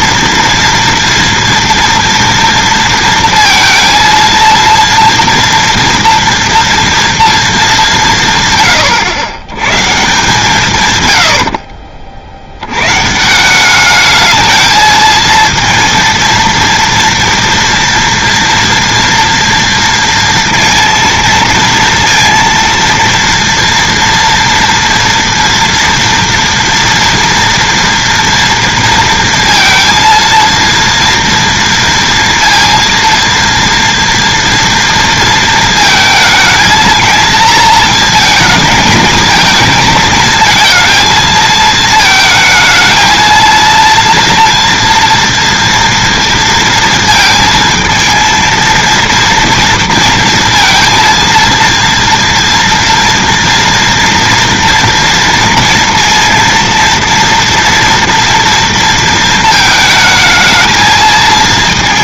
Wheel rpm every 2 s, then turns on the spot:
230, 230, 230, 230, 130, 140, 90, 220, 230, 230, 230, 230, 230, 230, 230, 230, 230, 230, 230, 220, 220, 220, 230, 230, 230, 230, 230, 230, 230, 230, 220.
none